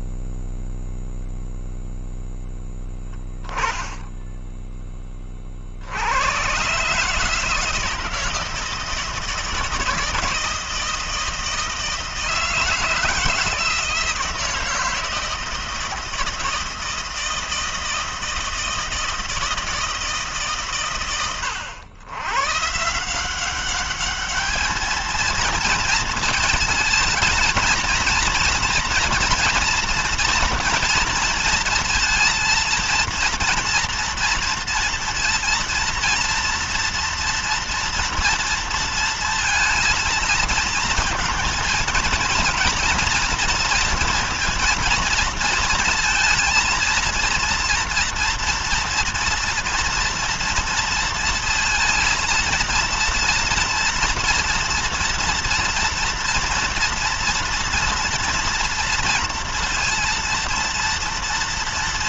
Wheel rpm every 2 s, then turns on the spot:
0, 10, 10, 90, 160, 160, 160, 160, 160, 160, 150, 110, 210, 220, 230, 230, 230, 230, 230, 230, 230, 230, 230, 230, 230, 230, 230, 230, 230, 230, 230.
none